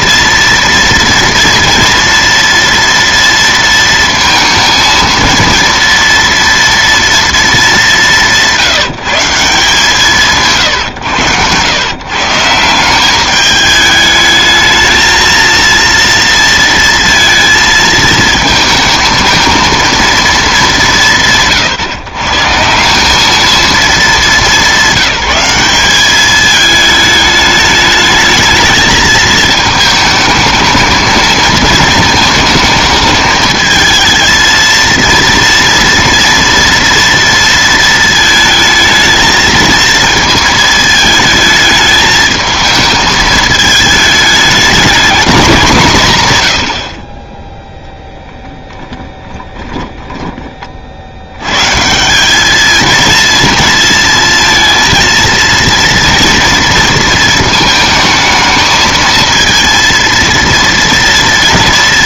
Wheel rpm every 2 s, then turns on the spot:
230, 230, 220, 240, 170, 140, 170, 220, 230, 220, 190, 160, 200, 210, 220, 220, 220, 230, 230, 220, 220, 220, 220, 80, 10, 40, 210, 230, 230, 220, 230.
48-50